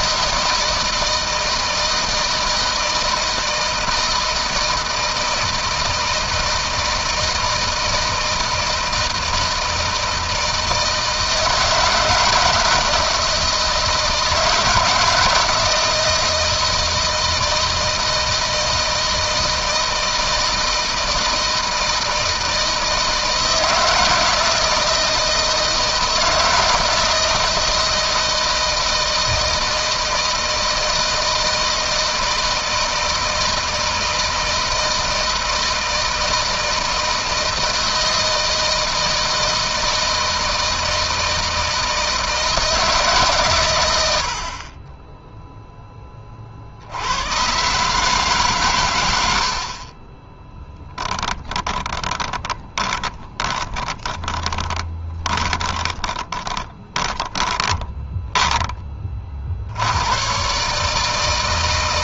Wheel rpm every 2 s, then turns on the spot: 160, 160, 160, 160, 160, 160, 160, 160, 160, 160, 160, 160, 160, 160, 160, 160, 160, 160, 160, 160, 160, 160, 30, 50, 130, 10, 20, 20, 20, 20, 130.
50-58